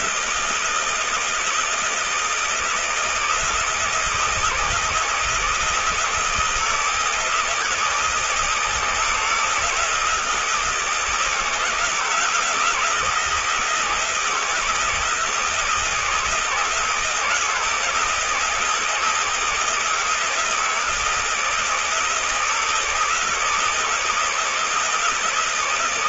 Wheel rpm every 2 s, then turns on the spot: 160, 160, 160, 160, 160, 160, 170, 160, 160, 160, 160, 160, 160.
none